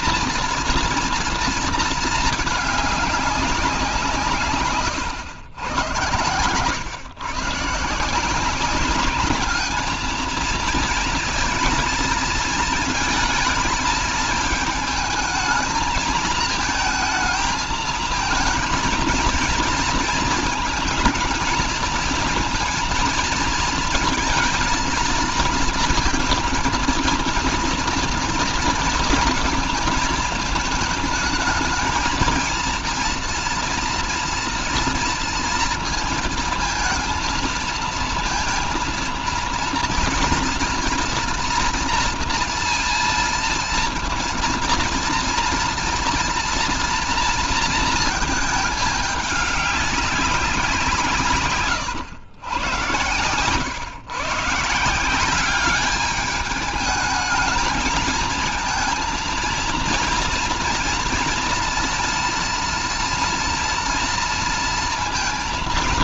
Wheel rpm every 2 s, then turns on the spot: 230, 220, 120, 120, 190, 230, 230, 220, 220, 230, 220, 230, 230, 230, 230, 220, 230, 230, 230, 230, 230, 230, 230, 240, 210, 170, 100, 160, 210, 230, 240, 230, 230.
none